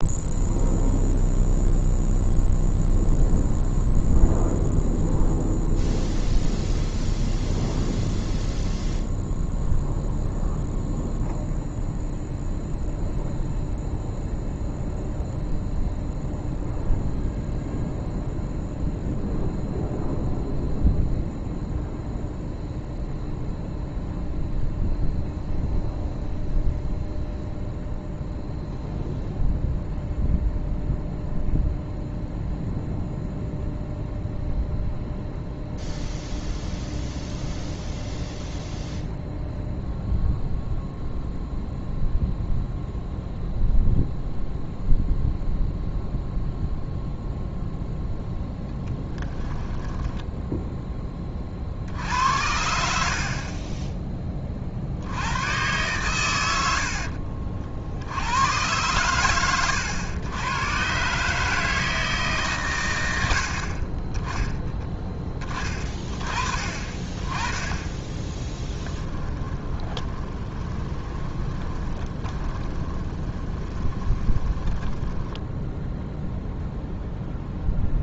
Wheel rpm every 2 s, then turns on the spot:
0, 0, 0, 0, 0, 0, 0, 0, 0, 0, 0, 0, 0, 0, 0, 0, 0, 0, 0, 0, 0, 0, 0, 0, 10, 10, 60, 50, 80, 120, 120, 120, 20, 30, 20, 20, 20, 10, 0.
48-50 68-76